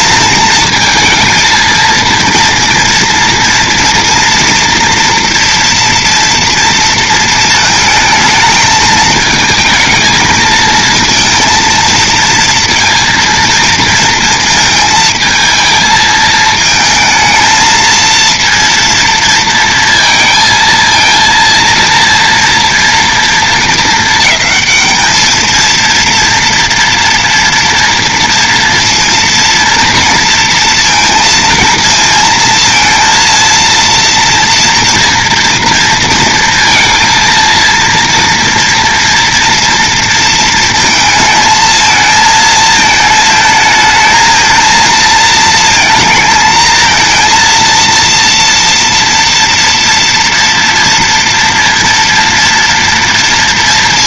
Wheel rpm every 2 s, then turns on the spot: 220, 230, 230, 230, 220, 220, 230, 220, 220, 230, 230, 240, 220, 240, 230, 230, 230, 240, 230, 240, 230, 220, 220, 220, 230, 230, 230.
none